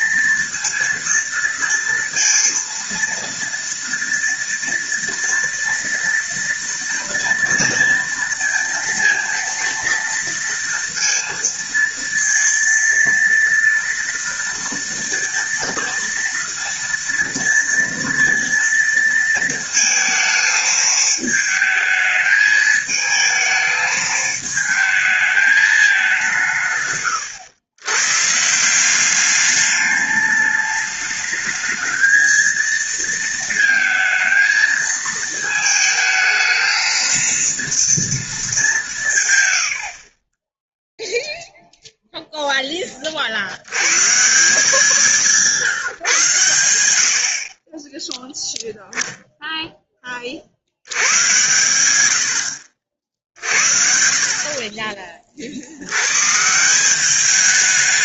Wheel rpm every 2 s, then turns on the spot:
230, 230, 230, 230, 230, 230, 230, 230, 230, 230, 220, 220, 220, 150, 160, 210, 230, 220, 220, 200, 10, 10, 170, 110, 0, 80, 70, 30, 170.
none